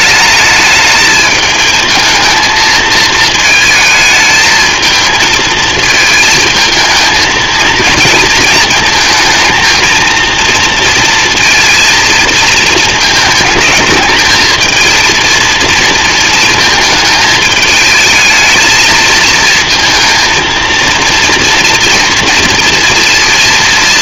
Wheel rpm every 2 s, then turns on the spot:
210, 220, 220, 220, 230, 230, 230, 220, 220, 220, 230, 230.
none